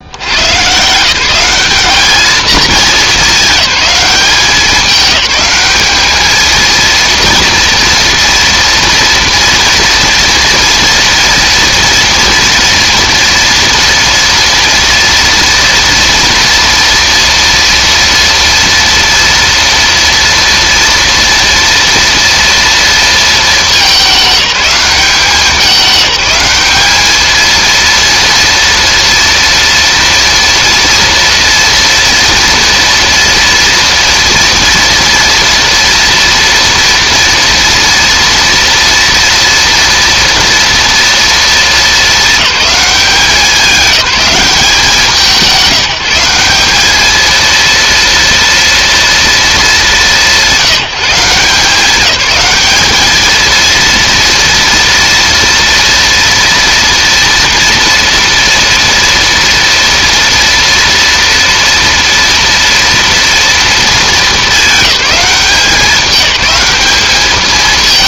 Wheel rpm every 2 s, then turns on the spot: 160, 210, 200, 230, 230, 230, 230, 230, 230, 230, 230, 220, 190, 220, 240, 230, 230, 230, 230, 230, 230, 190, 180, 220, 230, 170, 220, 230, 230, 230, 230, 230, 200, 200.
none